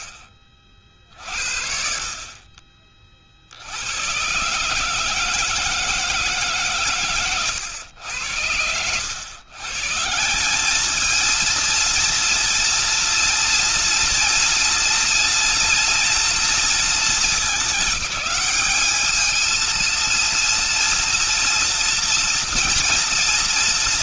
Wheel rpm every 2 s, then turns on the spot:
40, 40, 140, 140, 90, 210, 230, 230, 230, 210, 230, 240.
none